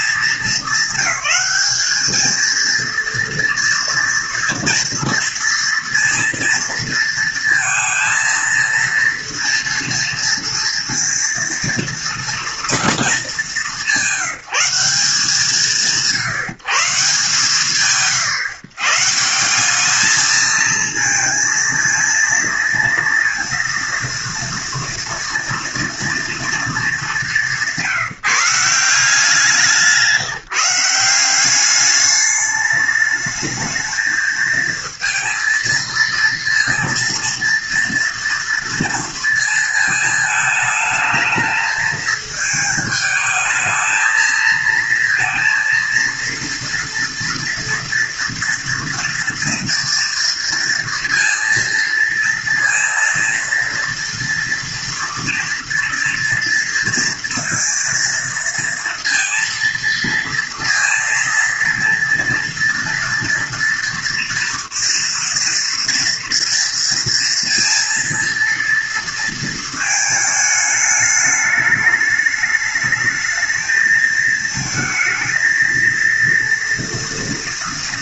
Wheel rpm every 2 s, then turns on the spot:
200, 230, 230, 230, 230, 230, 230, 170, 130, 160, 220, 230, 240, 220, 170, 180, 210, 230, 230, 230, 220, 220, 230, 230, 230, 230, 230, 230, 230, 230, 230, 230, 230, 230, 230, 210, 210, 220, 230.
none